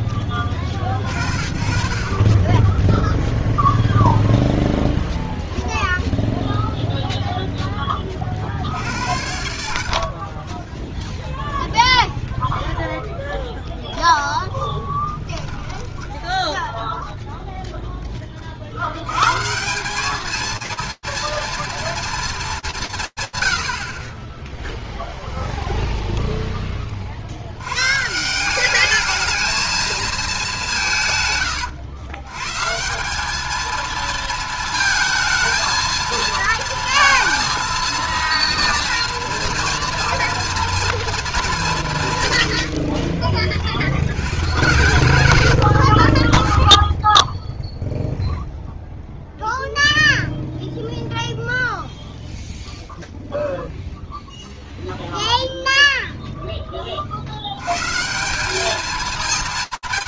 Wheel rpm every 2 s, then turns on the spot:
40, 0, 0, 0, 80, 0, 0, 10, 0, 40, 220, 180, 0, 60, 220, 130, 200, 220, 230, 230, 230, 30, 130, 0, 0, 0, 0, 0, 20, 210.
14-16